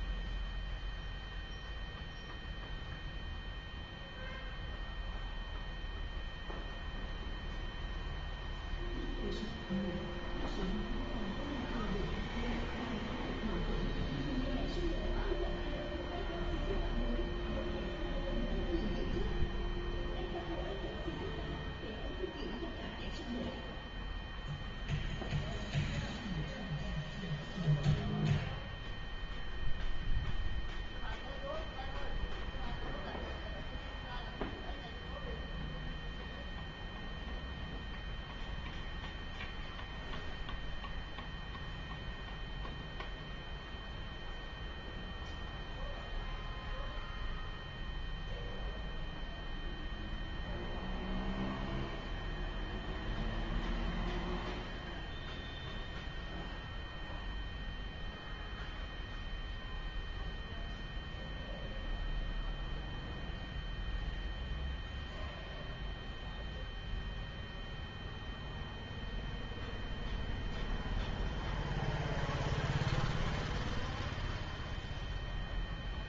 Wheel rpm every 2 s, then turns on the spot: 0, 0, 0, 0, 0, 0, 0, 0, 0, 0, 0, 0, 0, 0, 0, 0, 0, 0, 0, 0, 0, 0, 0, 0, 0, 0, 0, 0, 0, 0, 0, 0, 0, 0, 0, 0, 0, 0.
none